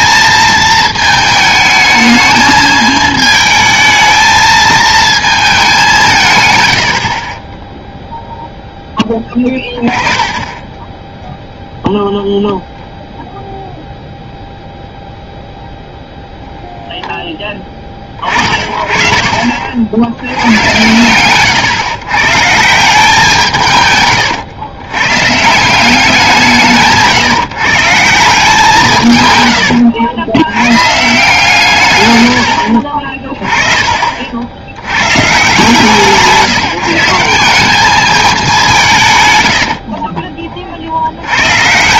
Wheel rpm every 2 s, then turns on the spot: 220, 220, 220, 90, 10, 10, 0, 0, 0, 30, 110, 160, 100, 160, 160, 130, 60, 70, 160, 180, 50.
none